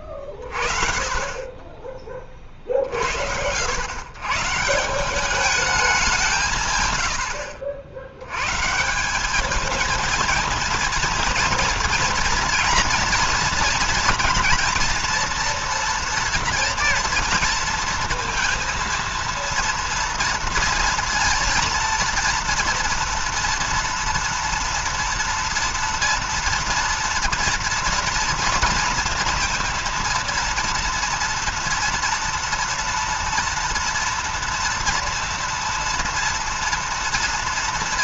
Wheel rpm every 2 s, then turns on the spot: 50, 50, 160, 160, 130, 230, 230, 240, 230, 230, 230, 230, 230, 230, 230, 230, 230, 230, 230.
none